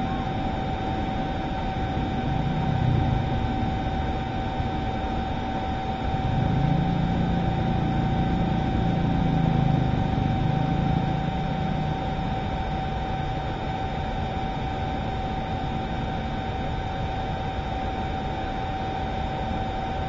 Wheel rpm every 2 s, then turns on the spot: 0, 0, 0, 0, 0, 0, 0, 0, 0, 0.
none